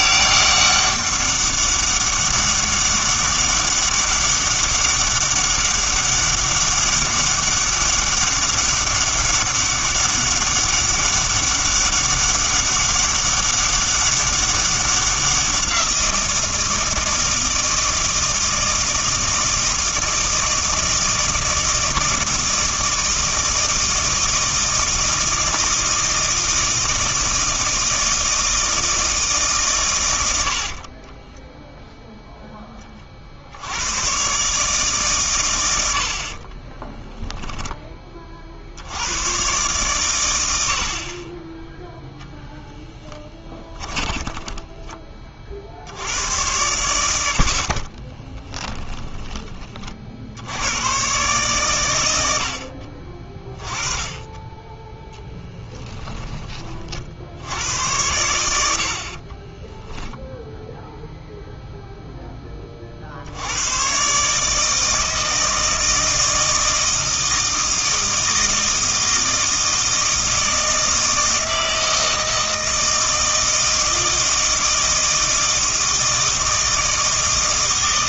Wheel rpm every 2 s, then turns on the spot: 200, 200, 200, 200, 200, 200, 200, 190, 160, 160, 160, 160, 160, 160, 160, 40, 10, 140, 30, 70, 70, 10, 10, 100, 10, 100, 50, 10, 40, 60, 0, 30, 160, 160, 160, 160, 160, 160, 160.
30-32 36-38 48-50